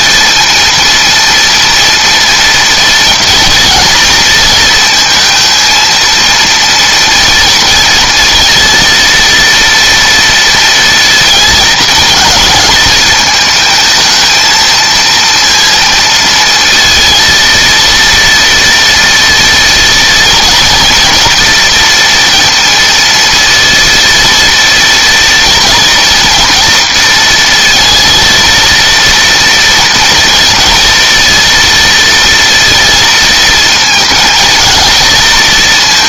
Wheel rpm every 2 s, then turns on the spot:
230, 230, 230, 230, 230, 230, 220, 230, 230, 230, 230, 230, 230, 230, 230, 230, 230, 230.
none